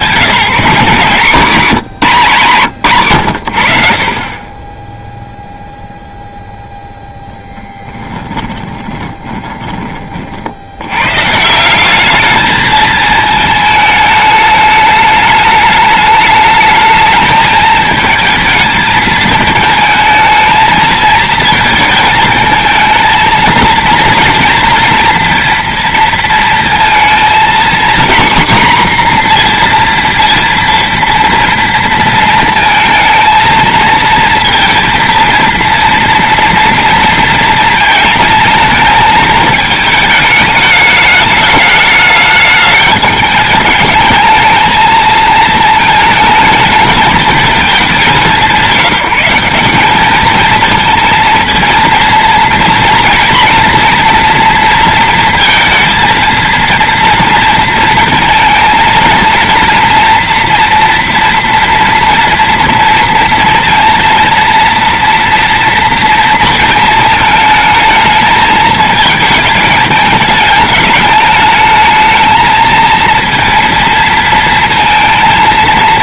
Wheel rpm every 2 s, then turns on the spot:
140, 90, 0, 10, 20, 160, 220, 210, 220, 220, 220, 230, 230, 230, 240, 230, 230, 230, 230, 220, 210, 210, 220, 210, 190, 230, 230, 230, 230, 230, 230, 230, 240, 220, 210, 210, 230, 230.
6-10